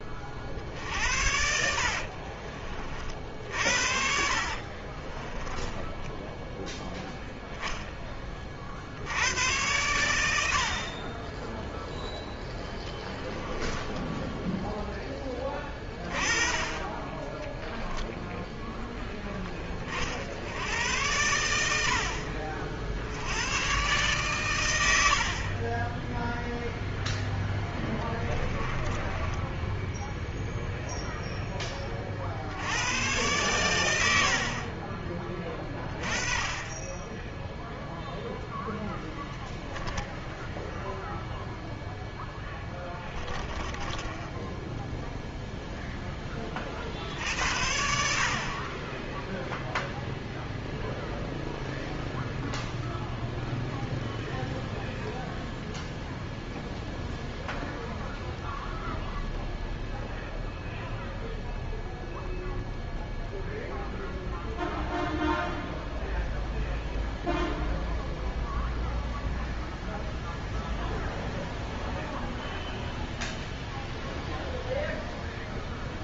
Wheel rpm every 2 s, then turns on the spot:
50, 40, 40, 0, 60, 50, 0, 10, 10, 10, 90, 60, 100, 0, 20, 0, 80, 40, 10, 0, 0, 10, 0, 40, 30, 0, 0, 0, 0, 0, 0, 0, 0, 0, 0, 0, 0, 0.
4-6 24-26 28-30 42-44